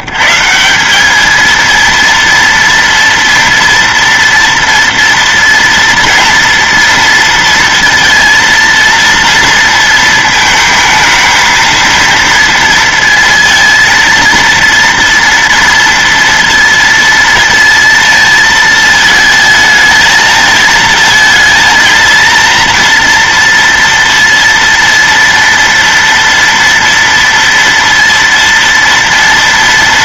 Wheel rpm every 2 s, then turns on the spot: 140, 230, 230, 230, 230, 230, 230, 230, 230, 230, 220, 230, 230, 230, 230.
none